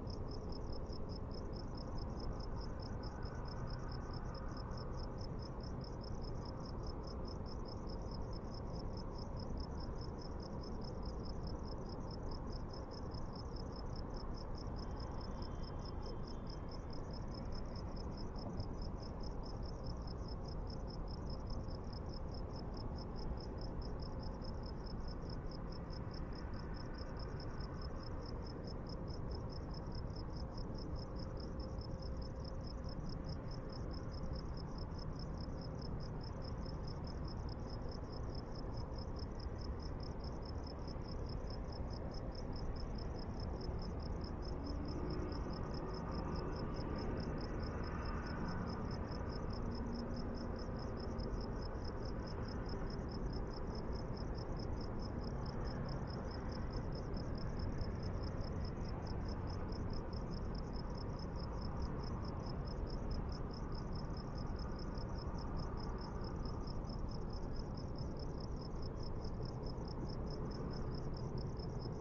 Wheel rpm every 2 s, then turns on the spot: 0, 0, 0, 0, 0, 0, 0, 0, 0, 0, 0, 0, 0, 0, 0, 0, 0, 0, 0, 0, 0, 0, 0, 0, 0, 0, 0, 0, 0, 0, 0, 0, 0, 0, 0, 0.
none